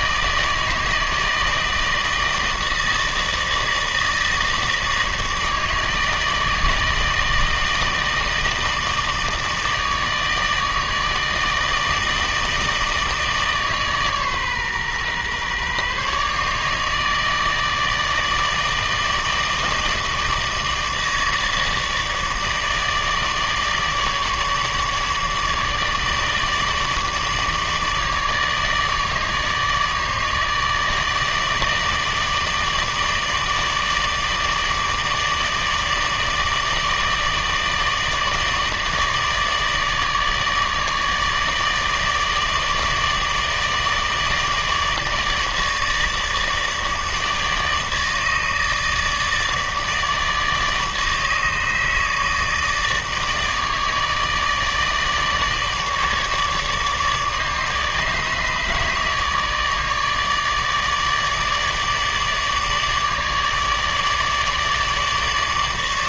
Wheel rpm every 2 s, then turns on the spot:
160, 160, 160, 160, 160, 160, 160, 130, 150, 160, 160, 150, 150, 160, 150, 160, 160, 150, 150, 160, 150, 150, 150, 150, 160, 150, 150, 150, 150, 150, 150, 150, 150.
none